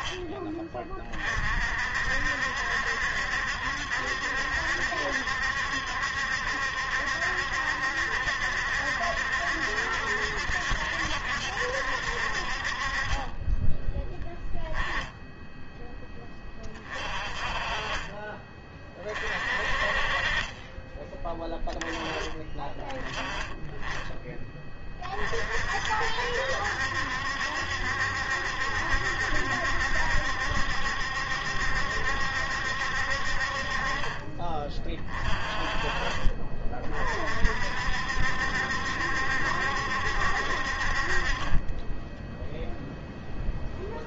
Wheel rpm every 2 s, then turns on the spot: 30, 70, 70, 70, 70, 70, 30, 10, 30, 30, 20, 20, 20, 70, 70, 70, 60, 30, 40, 70, 50, 0.
none